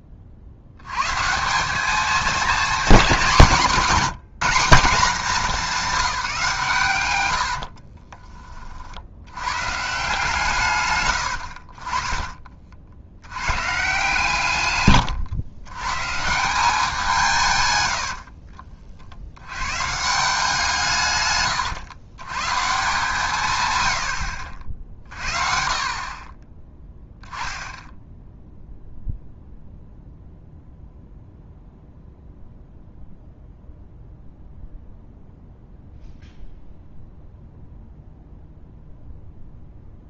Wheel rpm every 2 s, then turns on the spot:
80, 210, 200, 170, 30, 130, 50, 140, 180, 50, 170, 140, 60, 20, 0, 0, 0, 0, 0, 0.
18-20